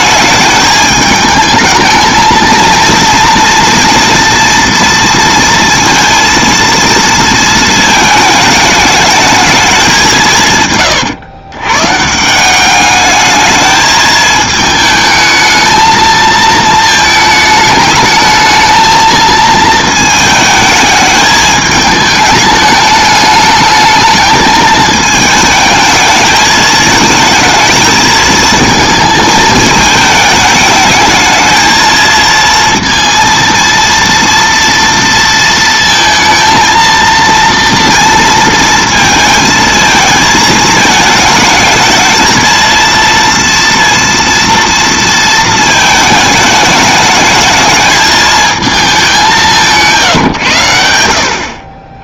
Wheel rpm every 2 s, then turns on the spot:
210, 230, 230, 230, 210, 130, 200, 220, 220, 220, 220, 210, 210, 220, 220, 220, 230, 230, 230, 230, 220, 230, 230, 210, 210, 90.
none